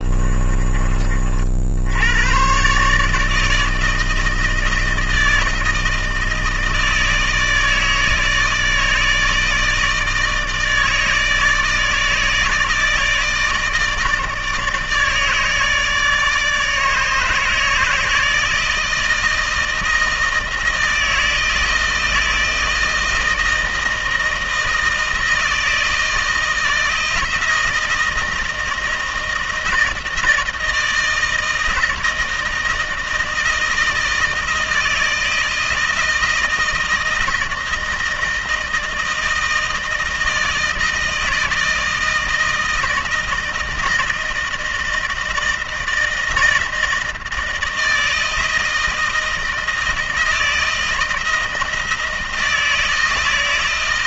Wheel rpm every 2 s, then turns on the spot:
40, 140, 160, 160, 160, 160, 160, 160, 150, 160, 160, 160, 160, 170, 160, 160, 160, 160, 160, 160, 160, 160, 160, 160, 160, 160, 160.
none